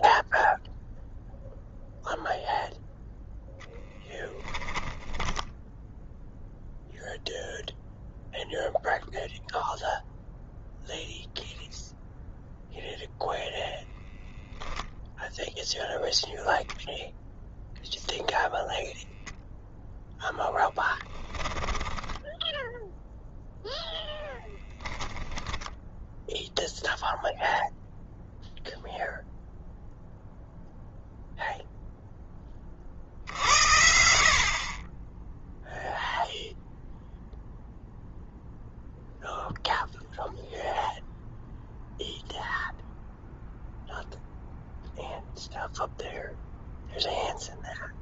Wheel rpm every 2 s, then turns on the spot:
0, 0, 10, 0, 0, 0, 0, 10, 0, 10, 10, 0, 0, 0, 0, 0, 40, 20, 0, 0, 0, 0, 0, 0.
20-22